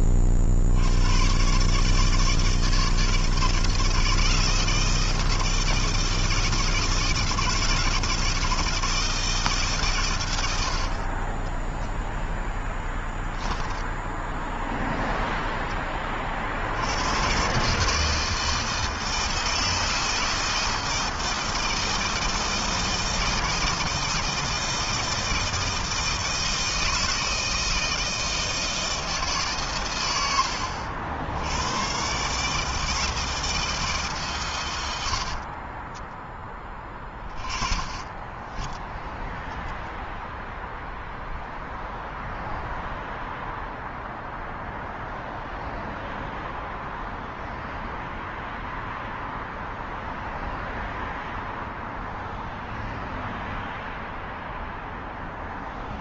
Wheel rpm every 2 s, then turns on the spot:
80, 160, 160, 160, 160, 40, 10, 0, 130, 160, 160, 160, 160, 160, 90, 140, 150, 20, 20, 0, 0, 0, 0, 0, 0, 0, 0, 0.
12-14 36-38